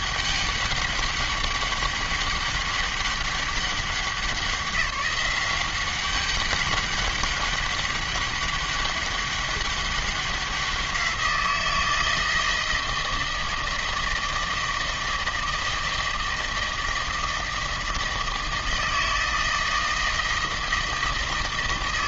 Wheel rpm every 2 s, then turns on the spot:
200, 200, 190, 200, 200, 180, 160, 160, 160, 160, 160.
none